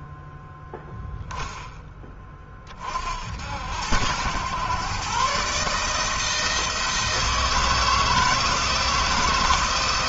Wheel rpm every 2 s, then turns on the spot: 10, 60, 130, 160, 160.
none